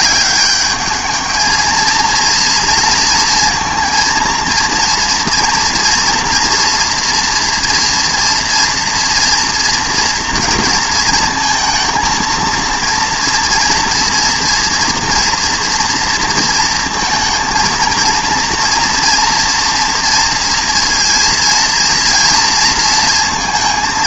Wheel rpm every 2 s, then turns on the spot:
210, 230, 230, 230, 230, 230, 230, 230, 230, 230, 230, 230.
none